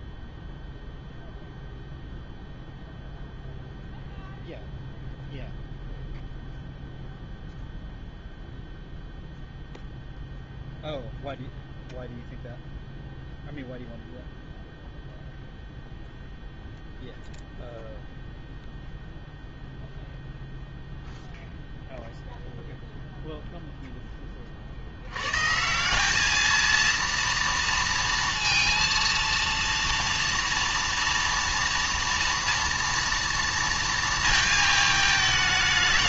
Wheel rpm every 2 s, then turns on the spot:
0, 0, 0, 0, 0, 0, 0, 0, 0, 0, 0, 0, 40, 220, 230, 230, 230, 220.
none